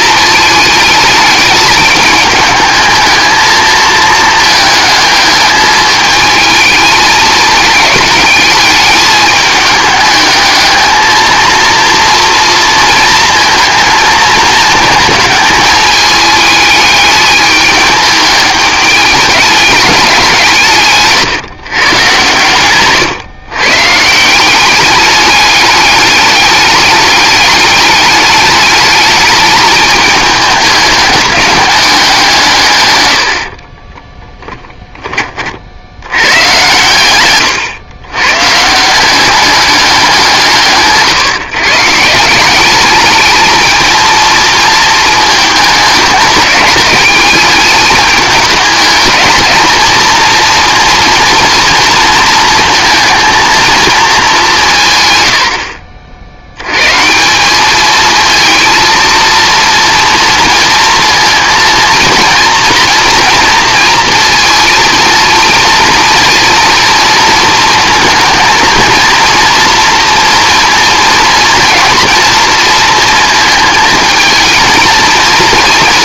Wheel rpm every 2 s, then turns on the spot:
220, 210, 220, 220, 210, 220, 230, 220, 210, 210, 160, 130, 200, 210, 210, 210, 140, 20, 110, 160, 150, 200, 220, 210, 220, 230, 230, 160, 120, 230, 230, 230, 230, 230, 230, 230, 230, 230.
34-36